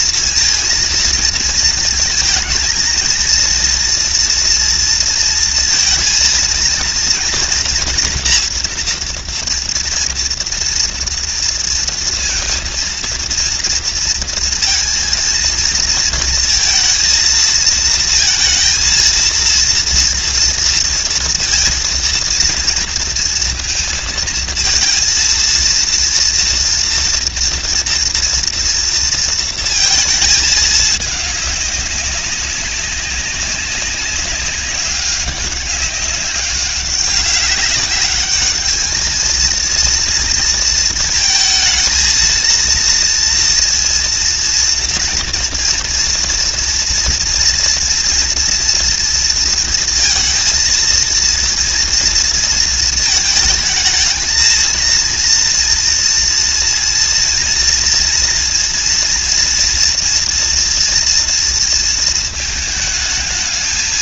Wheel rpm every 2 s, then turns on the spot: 230, 230, 230, 230, 230, 230, 230, 230, 230, 230, 230, 230, 230, 240, 230, 210, 190, 200, 200, 220, 220, 230, 230, 240, 240, 230, 220, 230, 230, 240, 230, 220.
none